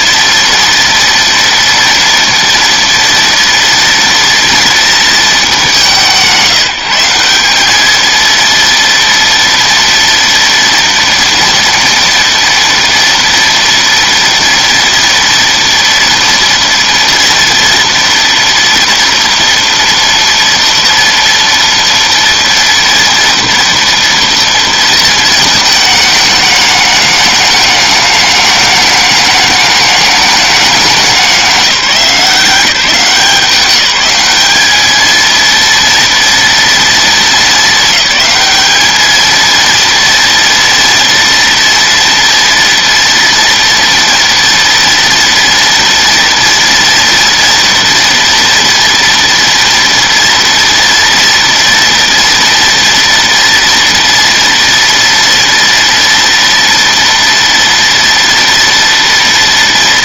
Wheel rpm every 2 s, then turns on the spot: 230, 230, 220, 170, 230, 230, 230, 230, 230, 230, 230, 230, 220, 210, 210, 200, 170, 220, 220, 210, 230, 230, 240, 230, 230, 230, 230, 230, 230, 230.
none